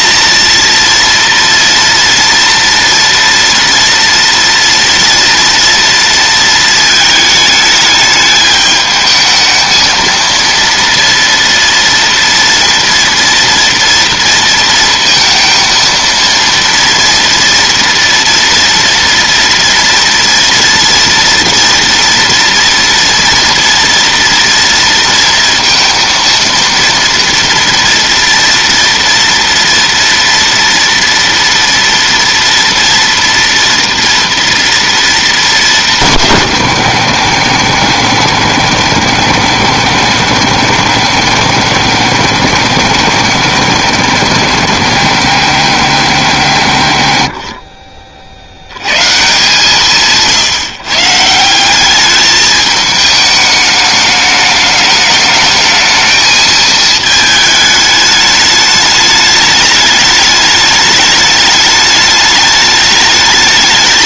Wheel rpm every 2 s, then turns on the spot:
230, 230, 230, 230, 210, 230, 230, 230, 230, 230, 230, 230, 230, 230, 230, 230, 240, 230, 130, 90, 100, 90, 100, 90, 100, 140, 210, 210, 220, 210, 210, 210.
none